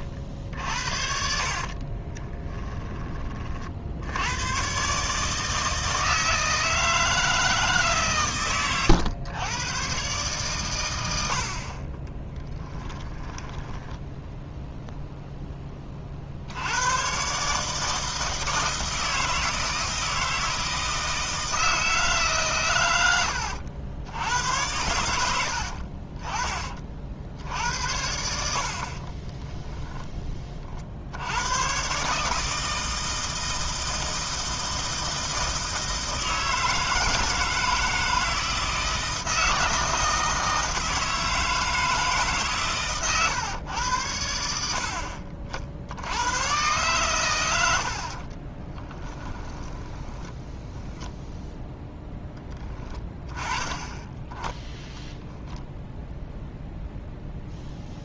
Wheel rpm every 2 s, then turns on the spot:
60, 20, 120, 160, 110, 110, 20, 10, 90, 160, 160, 110, 90, 40, 60, 40, 160, 160, 160, 160, 160, 130, 60, 120, 40, 10, 10, 10, 0.
2-4 12-14 48-52